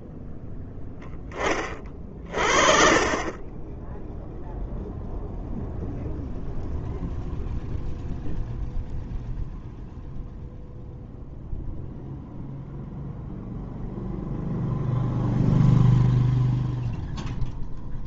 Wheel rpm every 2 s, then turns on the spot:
0, 40, 0, 0, 0, 0, 0, 0, 0.
none